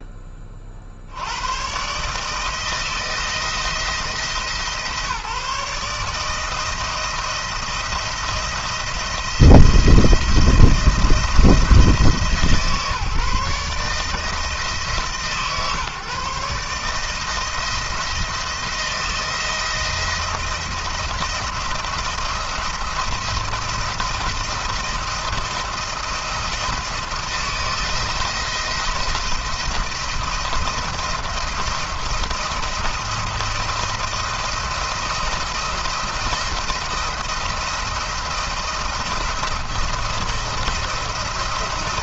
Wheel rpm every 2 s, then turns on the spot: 20, 160, 160, 160, 170, 170, 150, 160, 150, 170, 170, 170, 170, 170, 170, 170, 170, 170, 170, 170, 160.
none